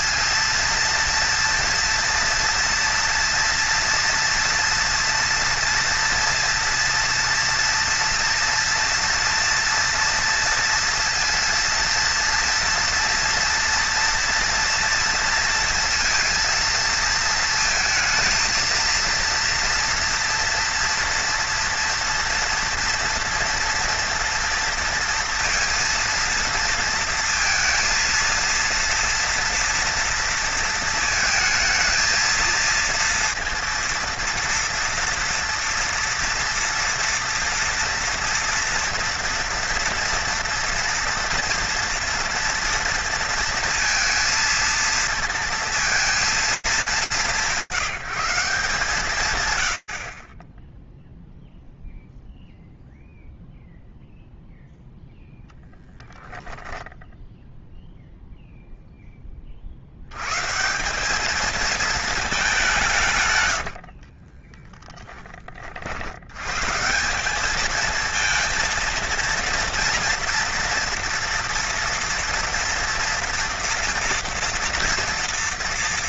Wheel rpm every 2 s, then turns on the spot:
230, 230, 230, 230, 230, 230, 230, 230, 230, 230, 230, 230, 230, 230, 230, 230, 230, 230, 230, 230, 240, 230, 230, 200, 170, 20, 0, 0, 0, 40, 220, 100, 40, 210, 230, 230, 230, 240.
62-64